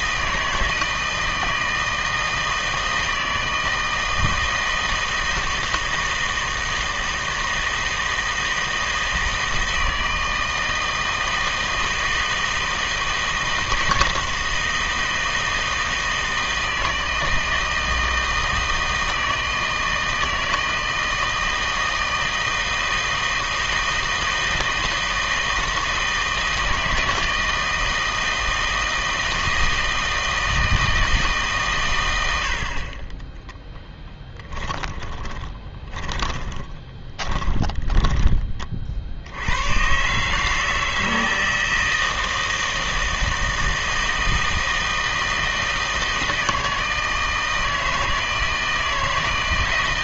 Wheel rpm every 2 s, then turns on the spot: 160, 160, 160, 160, 160, 160, 160, 160, 160, 160, 160, 160, 160, 160, 160, 160, 70, 10, 20, 40, 160, 160, 160, 160, 160.
34-38